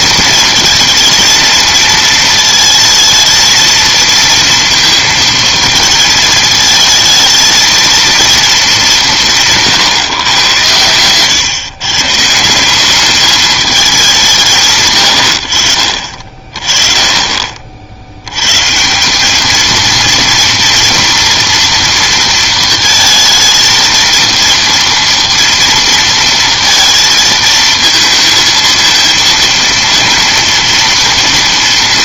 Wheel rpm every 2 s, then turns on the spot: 220, 220, 230, 220, 210, 110, 170, 160, 40, 130, 230, 230, 230, 230, 230, 230.
none